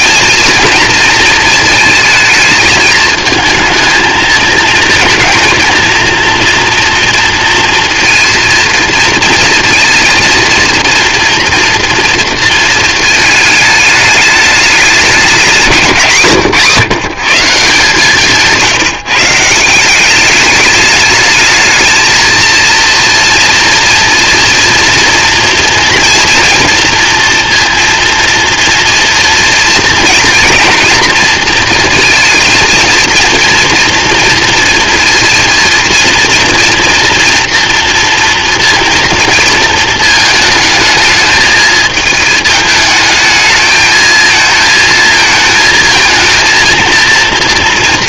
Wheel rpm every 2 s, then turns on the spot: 230, 220, 230, 230, 230, 230, 230, 210, 160, 160, 200, 230, 240, 230, 230, 240, 230, 230, 230, 230, 220, 220, 220, 230.
none